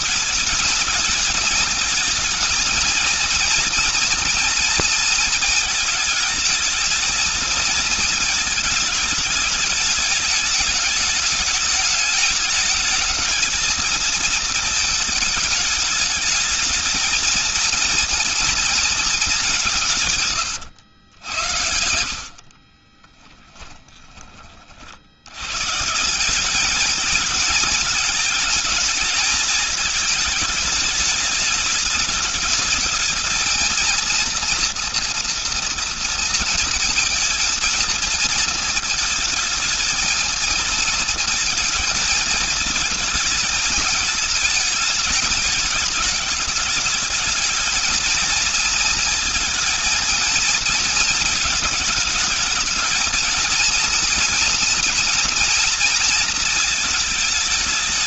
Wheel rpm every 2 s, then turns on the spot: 220, 230, 230, 220, 220, 210, 220, 220, 220, 230, 100, 40, 50, 220, 220, 210, 220, 240, 230, 230, 230, 220, 210, 210, 230, 220, 220, 240, 230.
22-24